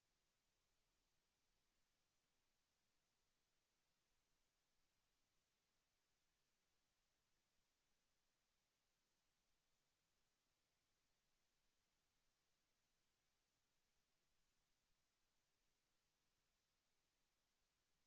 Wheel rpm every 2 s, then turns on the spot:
0, 0, 0, 0, 0, 0, 0, 0, 0.
none